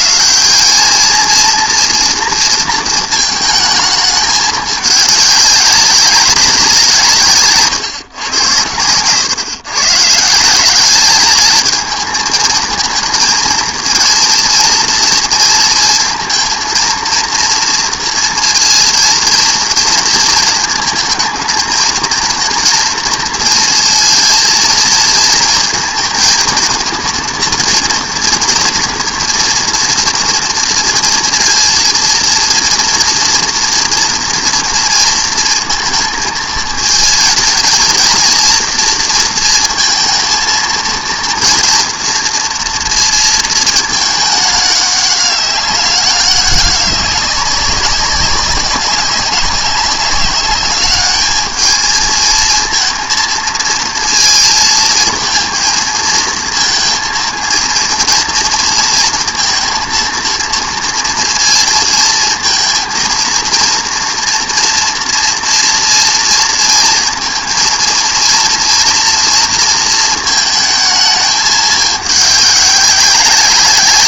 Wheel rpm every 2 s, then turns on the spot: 190, 230, 210, 190, 110, 190, 230, 230, 230, 230, 220, 230, 230, 230, 230, 230, 230, 230, 220, 230, 230, 230, 200, 190, 190, 200, 230, 230, 230, 230, 230, 230, 230, 230, 230, 220, 200.
none